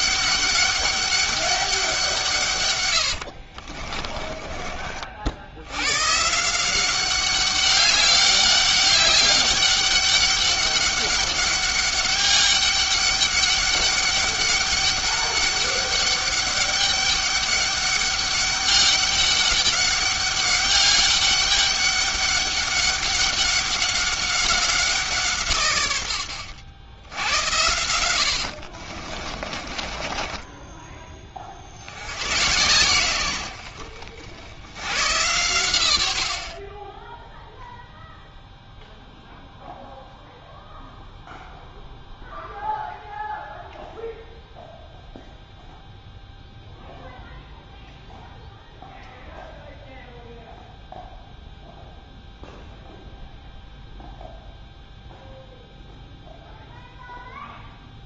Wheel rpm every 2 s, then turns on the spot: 200, 130, 40, 170, 200, 200, 200, 200, 200, 200, 200, 200, 190, 90, 60, 20, 110, 90, 30, 0, 0, 0, 0, 0, 0, 0, 0, 0, 0.
4-6 28-32